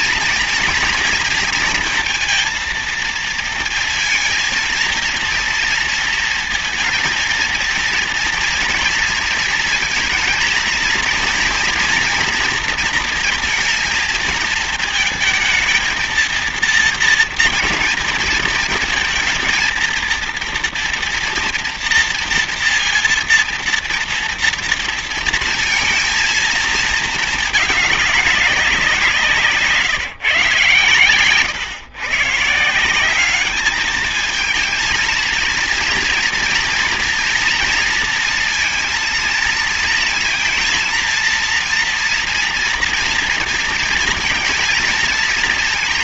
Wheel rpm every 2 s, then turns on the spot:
230, 230, 230, 230, 230, 220, 230, 230, 230, 230, 230, 230, 230, 220, 180, 130, 170, 230, 230, 230, 230, 240, 230.
none